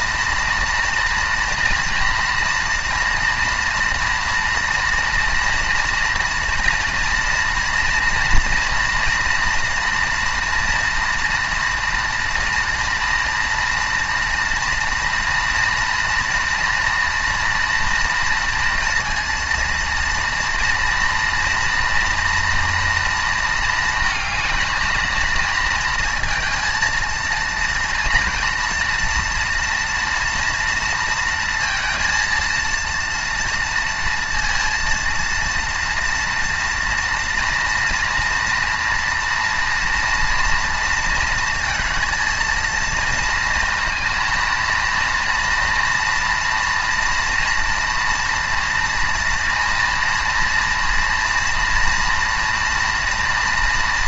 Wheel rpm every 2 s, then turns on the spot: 230, 230, 230, 240, 230, 230, 230, 230, 230, 230, 230, 240, 220, 230, 240, 230, 230, 230, 230, 230, 230, 230, 230, 230, 230, 230, 230.
none